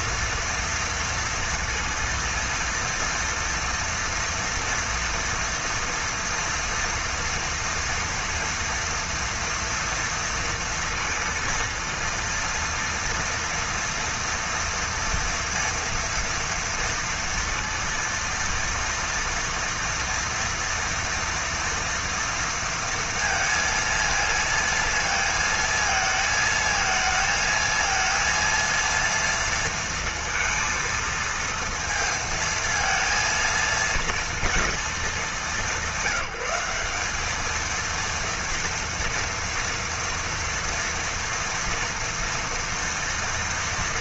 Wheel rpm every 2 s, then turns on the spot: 230, 230, 230, 230, 230, 230, 230, 230, 230, 230, 230, 230, 230, 220, 230, 230, 230, 220, 190, 230, 230, 230.
none